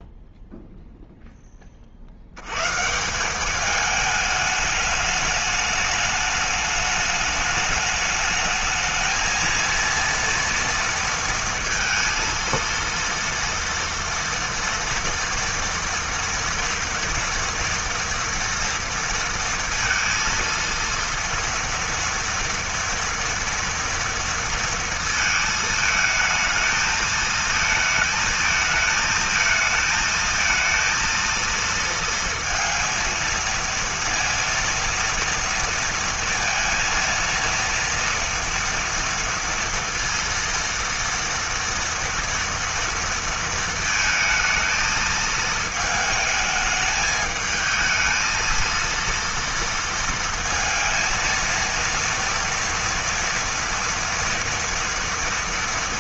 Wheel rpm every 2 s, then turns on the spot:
0, 170, 210, 210, 220, 230, 230, 230, 230, 230, 230, 240, 220, 220, 220, 230, 230, 230, 230, 230, 230, 230, 220, 220, 230, 230, 230, 230.
none